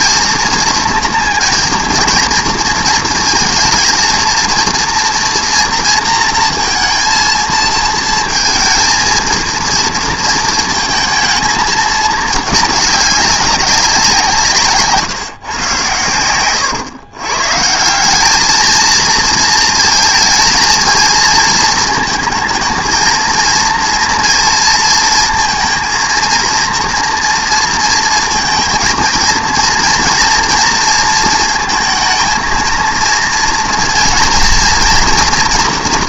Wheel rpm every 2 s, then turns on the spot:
230, 220, 230, 230, 220, 220, 210, 140, 120, 220, 220, 220, 230, 230, 230, 230, 230, 230.
16-18